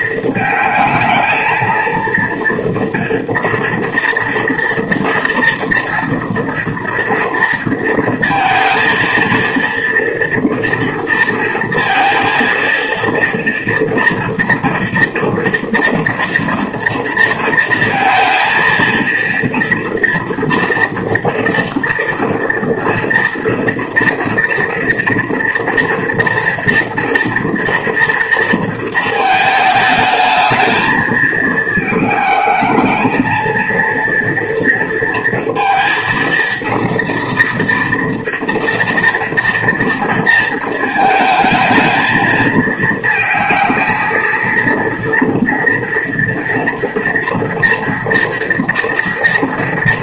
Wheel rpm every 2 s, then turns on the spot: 220, 230, 230, 230, 230, 230, 230, 230, 230, 230, 240, 230, 240, 230, 230, 220, 220, 230, 230, 230, 220, 220, 230, 230, 230.
none